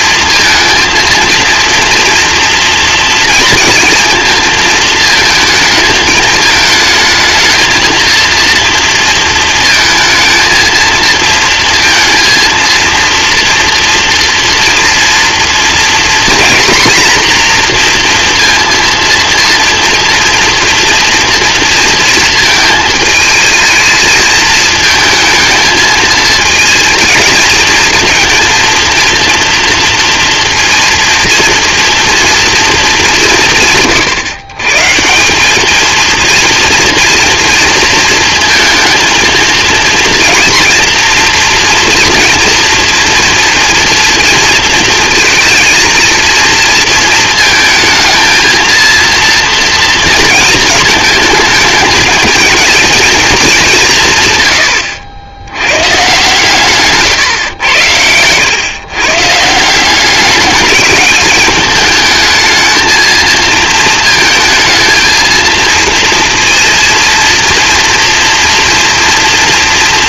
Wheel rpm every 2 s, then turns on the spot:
230, 240, 220, 220, 230, 230, 230, 230, 240, 230, 230, 220, 220, 230, 230, 230, 210, 150, 230, 230, 230, 230, 230, 230, 230, 220, 230, 100, 140, 120, 210, 220, 230, 230, 230.
none